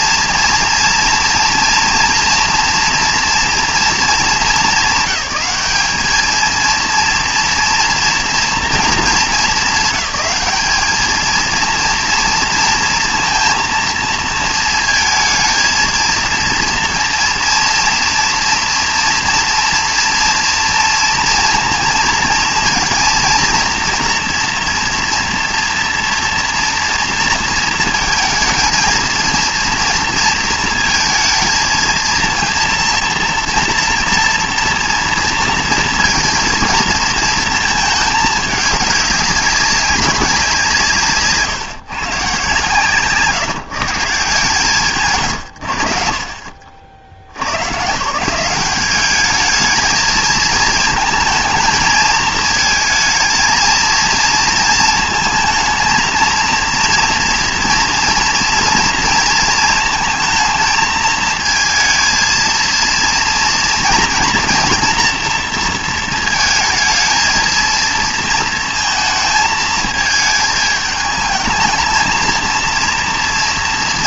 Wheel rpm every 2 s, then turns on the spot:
230, 230, 210, 230, 230, 200, 230, 220, 230, 230, 230, 230, 240, 230, 230, 230, 230, 230, 230, 210, 160, 140, 130, 50, 190, 220, 220, 230, 230, 230, 220, 230, 230, 220, 230, 220, 230.
none